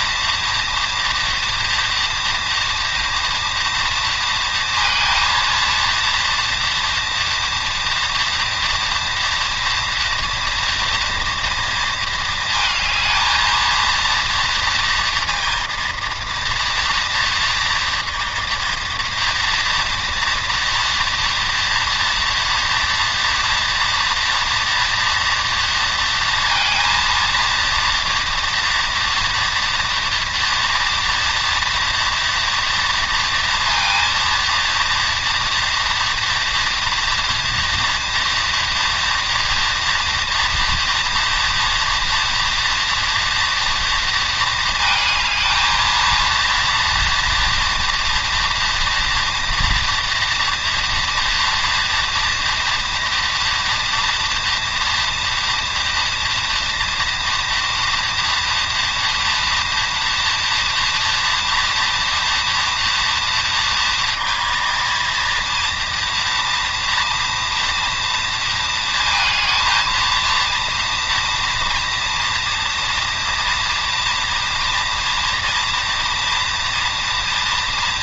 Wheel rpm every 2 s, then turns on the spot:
230, 230, 230, 230, 230, 240, 220, 230, 230, 230, 230, 230, 240, 230, 230, 230, 230, 230, 240, 240, 230, 230, 230, 240, 240, 240, 230, 230, 230, 230, 230, 230, 230, 230, 230, 230, 230, 230, 230.
none